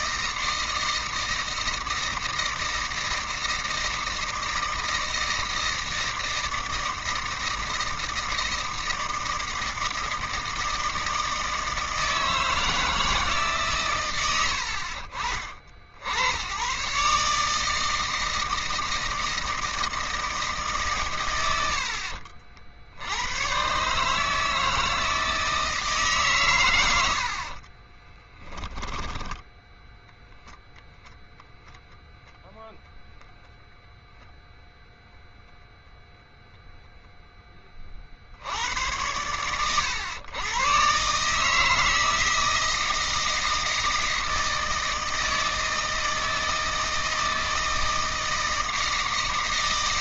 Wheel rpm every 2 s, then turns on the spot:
160, 160, 160, 160, 160, 160, 160, 80, 90, 160, 150, 80, 160, 130, 20, 0, 0, 0, 0, 80, 100, 160, 160, 160, 160.
28-30